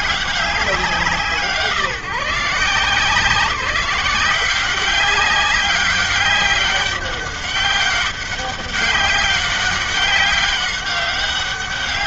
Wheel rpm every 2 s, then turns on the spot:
190, 150, 180, 200, 200, 200.
none